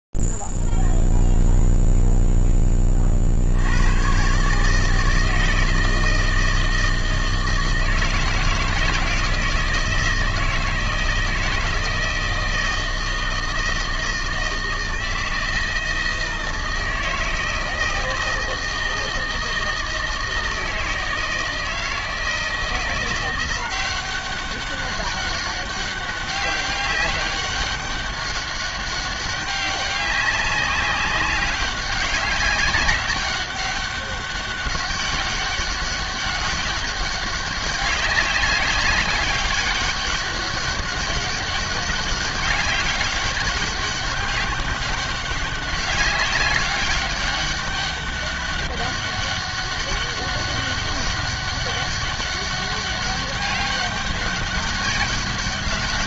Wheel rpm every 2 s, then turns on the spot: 0, 0, 80, 160, 160, 160, 160, 160, 160, 160, 160, 160, 190, 200, 200, 190, 200, 200, 200, 200, 200, 190, 200, 190, 200, 200, 200, 200.
none